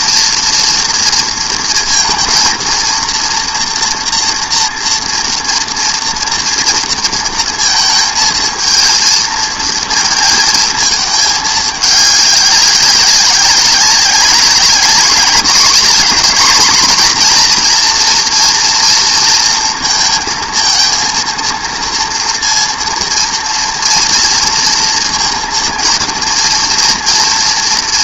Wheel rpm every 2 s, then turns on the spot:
230, 230, 240, 230, 220, 230, 200, 190, 230, 240, 220, 230, 230, 230.
none